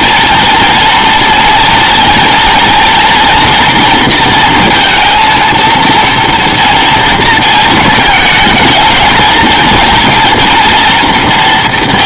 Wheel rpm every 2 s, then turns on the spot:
240, 240, 230, 230, 220, 240.
none